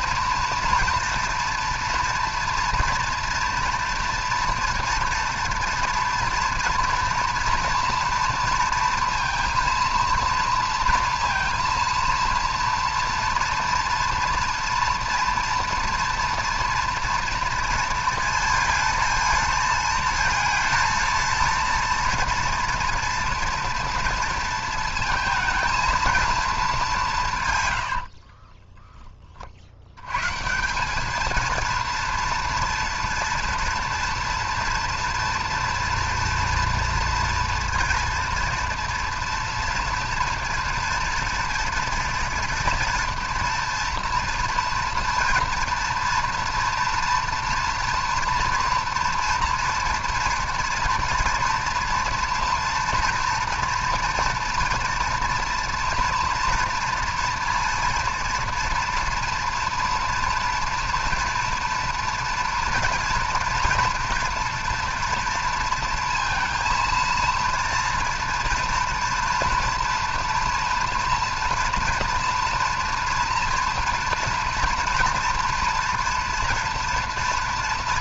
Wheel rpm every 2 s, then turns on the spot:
240, 230, 240, 230, 230, 230, 230, 230, 230, 230, 230, 230, 230, 220, 20, 180, 240, 230, 240, 230, 240, 230, 240, 230, 230, 230, 230, 230, 230, 240, 240, 240, 230, 230, 230, 230, 240, 240, 230.
28-30